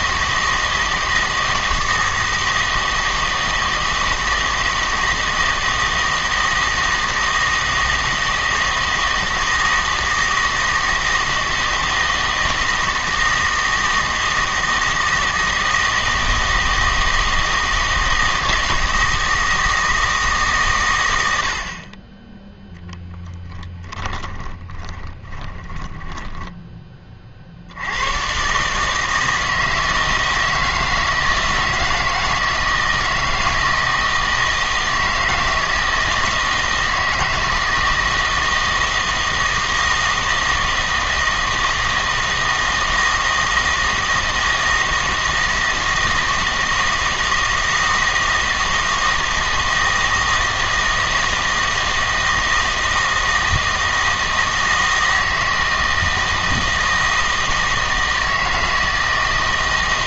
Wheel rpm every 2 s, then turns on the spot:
160, 160, 160, 160, 160, 160, 160, 160, 160, 160, 120, 0, 20, 20, 150, 160, 160, 160, 160, 160, 160, 160, 160, 160, 160, 160, 160, 160, 160, 160.
24-26